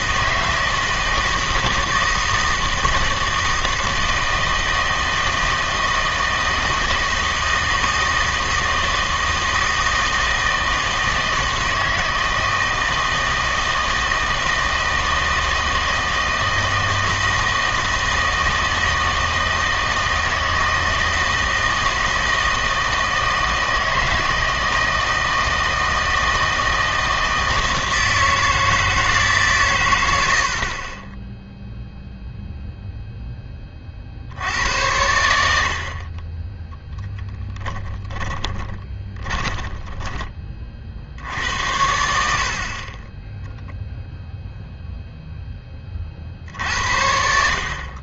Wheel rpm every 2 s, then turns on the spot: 160, 160, 160, 160, 160, 160, 160, 160, 160, 160, 160, 160, 160, 160, 160, 60, 0, 80, 10, 20, 30, 50, 0, 70.
38-40